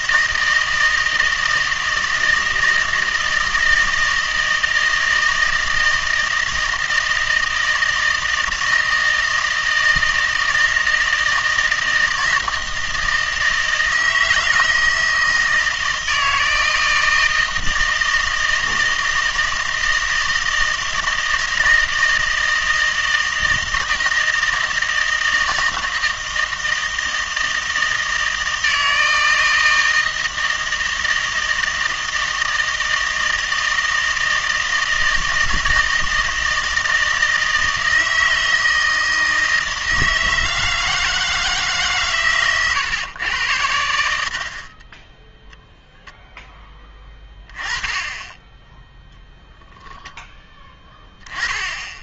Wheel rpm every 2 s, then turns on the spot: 160, 160, 160, 160, 160, 160, 160, 160, 160, 160, 160, 160, 160, 160, 160, 160, 160, 160, 160, 160, 160, 130, 40, 10, 10, 10.
none